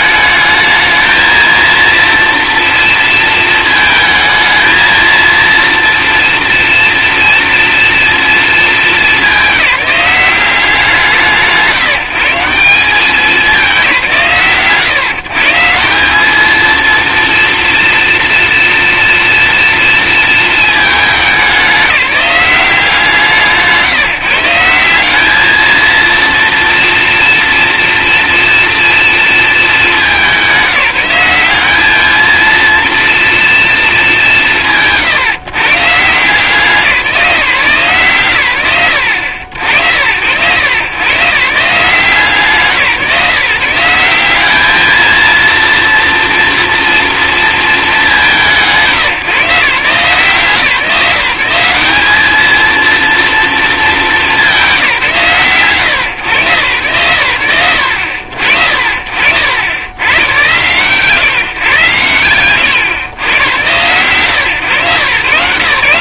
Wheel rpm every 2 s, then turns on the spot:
220, 230, 220, 230, 210, 170, 180, 120, 230, 230, 220, 180, 190, 230, 230, 180, 230, 150, 160, 60, 130, 160, 220, 240, 150, 170, 230, 180, 110, 60, 120, 110, 130.
none